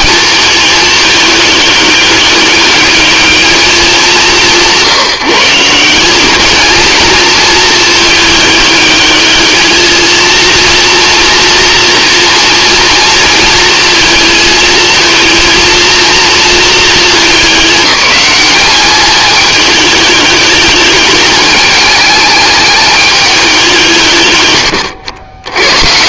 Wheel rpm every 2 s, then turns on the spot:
210, 200, 170, 220, 210, 230, 230, 220, 220, 210, 210, 210, 90.
none